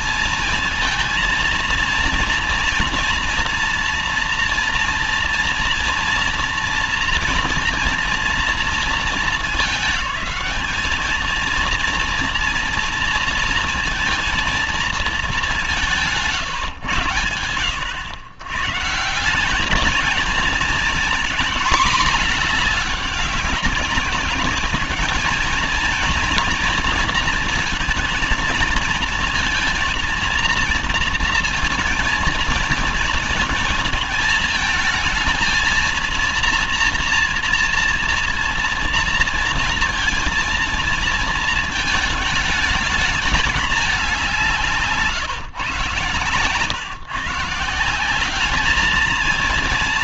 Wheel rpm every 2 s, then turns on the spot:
220, 230, 230, 230, 230, 210, 230, 230, 140, 120, 220, 220, 200, 240, 230, 230, 230, 220, 230, 230, 230, 210, 180, 130, 200.
none